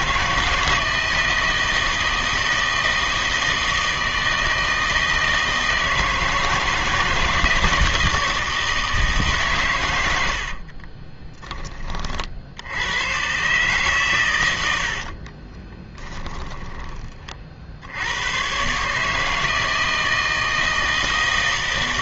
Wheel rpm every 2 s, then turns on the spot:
160, 160, 160, 160, 160, 50, 80, 90, 10, 130, 160.
10-12 14-16